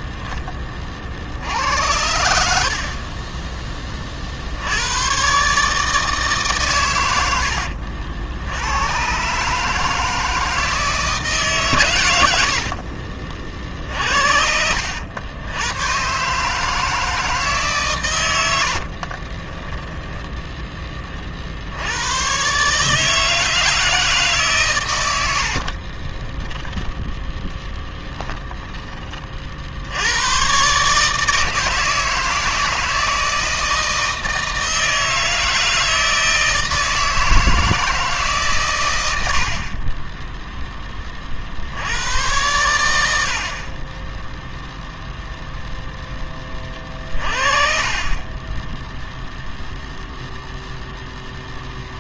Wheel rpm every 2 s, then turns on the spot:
10, 70, 60, 150, 70, 160, 90, 60, 140, 90, 10, 130, 140, 20, 20, 110, 160, 160, 160, 150, 10, 100, 0, 20, 20, 0.
26-30